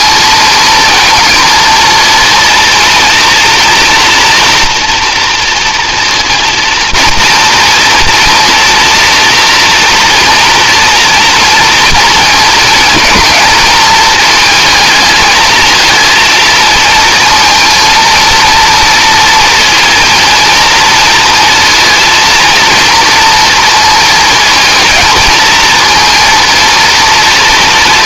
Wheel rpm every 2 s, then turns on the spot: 230, 230, 230, 230, 230, 230, 230, 220, 220, 230, 230, 230, 230, 230.
none